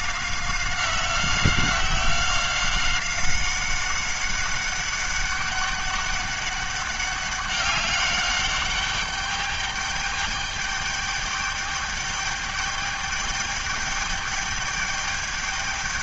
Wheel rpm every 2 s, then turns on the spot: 190, 190, 200, 200, 200, 210, 210, 210.
none